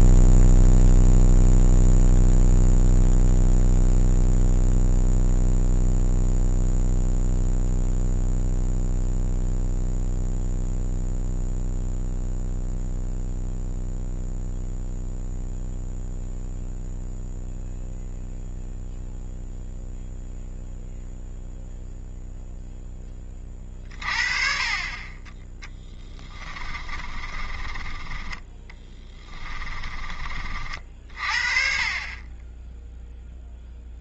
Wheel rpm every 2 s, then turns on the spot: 0, 0, 0, 0, 0, 0, 0, 0, 0, 0, 0, 0, 40, 30, 20, 40, 10.
26-30